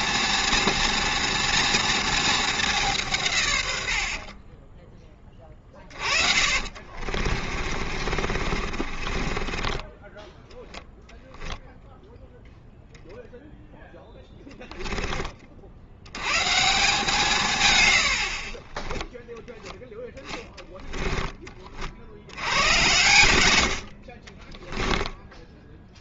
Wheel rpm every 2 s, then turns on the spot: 230, 200, 20, 50, 40, 0, 0, 10, 150, 20, 20, 90, 20.
6-10 14-16 18-22 24-26